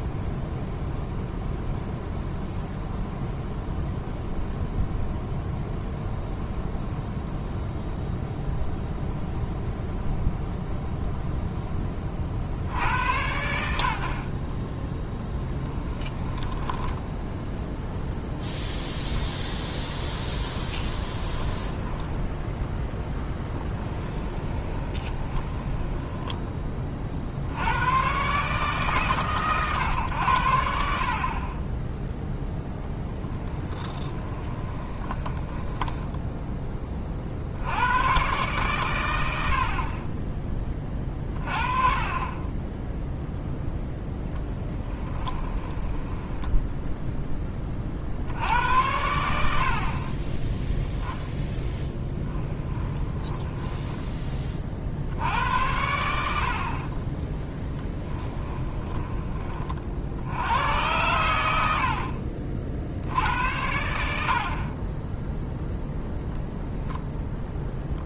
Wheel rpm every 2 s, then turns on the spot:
0, 0, 0, 0, 0, 0, 80, 20, 10, 10, 20, 10, 20, 20, 140, 80, 0, 20, 20, 120, 20, 20, 10, 10, 80, 10, 10, 40, 50, 20, 100, 60, 40, 0.
16-18 20-22 24-26 34-36 44-48 52-54 58-60